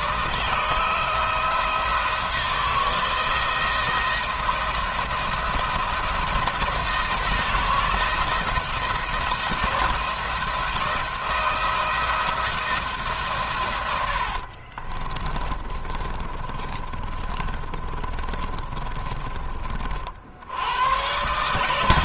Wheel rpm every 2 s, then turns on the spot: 160, 170, 170, 160, 160, 160, 160, 60, 30, 40, 90.
14-20